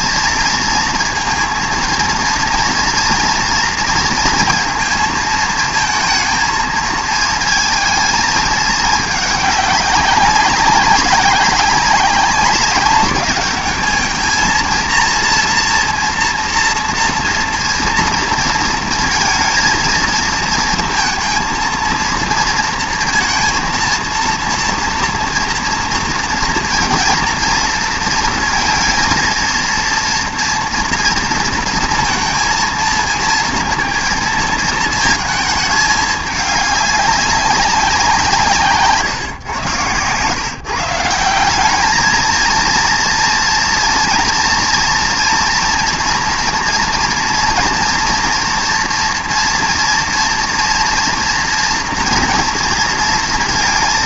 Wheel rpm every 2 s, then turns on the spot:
230, 230, 230, 220, 210, 200, 200, 230, 230, 230, 230, 230, 240, 230, 230, 230, 220, 220, 200, 140, 150, 230, 230, 230, 230, 230, 230.
none